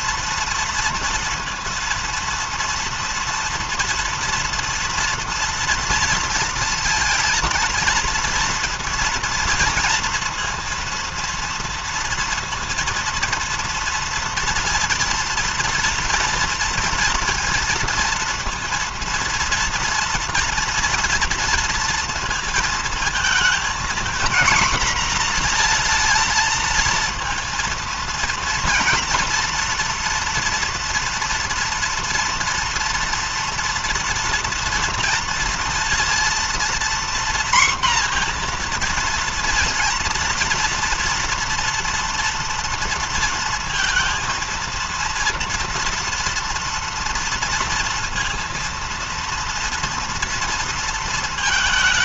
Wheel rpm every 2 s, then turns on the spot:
230, 230, 230, 230, 230, 230, 230, 230, 230, 230, 240, 230, 240, 230, 230, 230, 230, 230, 230, 240, 240, 230, 230, 230, 230, 230.
none